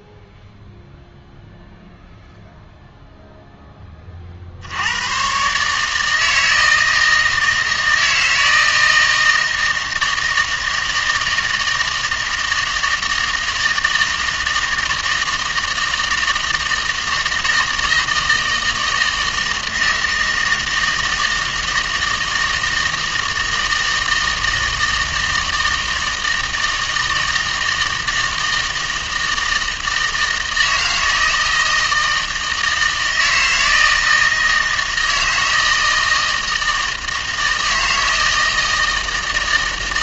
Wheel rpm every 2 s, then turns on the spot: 0, 0, 80, 160, 160, 160, 160, 160, 160, 160, 160, 160, 160, 160, 160, 160, 160, 160, 160, 160.
none